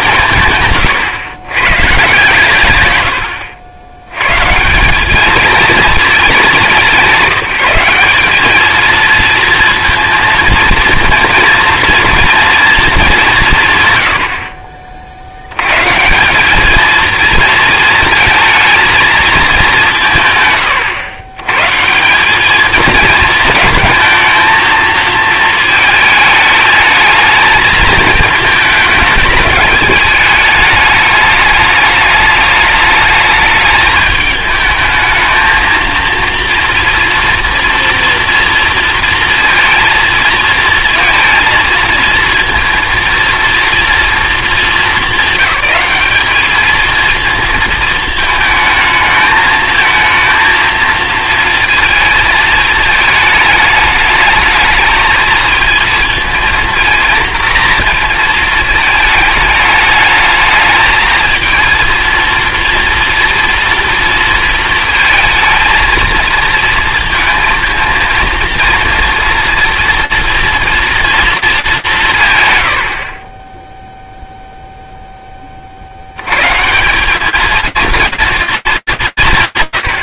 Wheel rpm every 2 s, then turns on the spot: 150, 120, 180, 180, 220, 230, 220, 50, 210, 220, 120, 220, 220, 220, 220, 210, 210, 220, 230, 230, 230, 230, 200, 220, 220, 230, 220, 220, 230, 220, 220, 230, 230, 230, 230, 230, 100, 0, 160, 220.
none